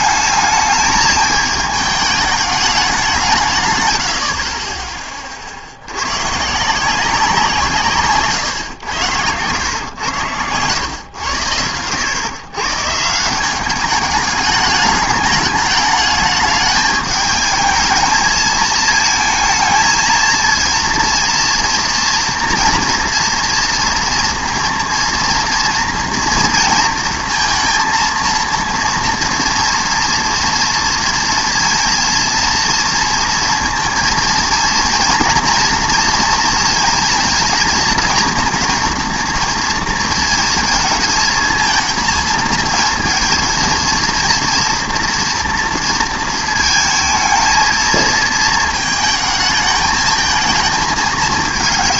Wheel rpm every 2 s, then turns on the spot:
220, 210, 40, 160, 120, 100, 140, 210, 210, 220, 230, 240, 230, 230, 230, 230, 230, 230, 230, 230, 220, 230, 240, 220, 220, 220.
none